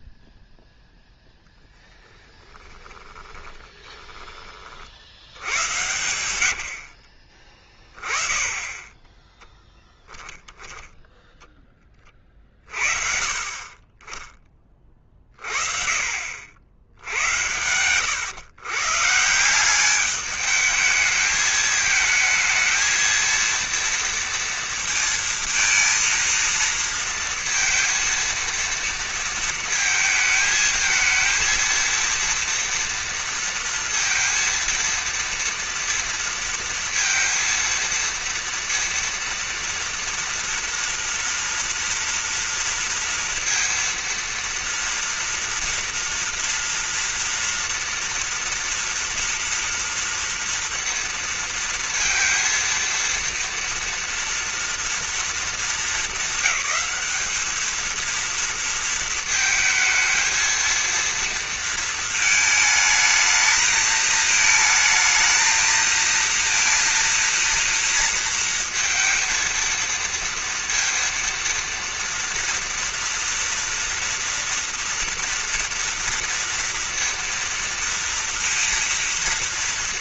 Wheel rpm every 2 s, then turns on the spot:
0, 10, 40, 80, 20, 10, 50, 30, 80, 130, 210, 220, 230, 230, 230, 220, 230, 230, 230, 230, 230, 230, 230, 240, 230, 230, 230, 230, 220, 230, 230, 220, 220, 230, 230, 230, 230, 230, 230, 230.
2-4 6-8